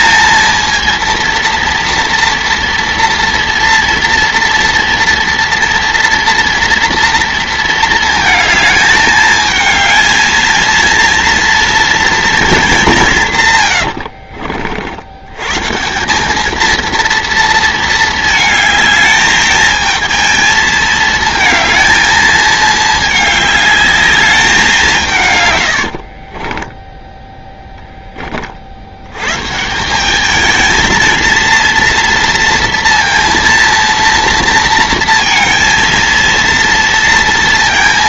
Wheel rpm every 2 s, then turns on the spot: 230, 230, 230, 230, 220, 220, 200, 60, 210, 220, 230, 220, 190, 30, 50, 220, 230, 230, 230.
26-28